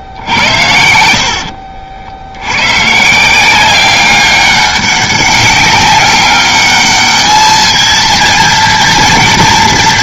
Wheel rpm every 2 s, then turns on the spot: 80, 130, 200, 210, 230.
none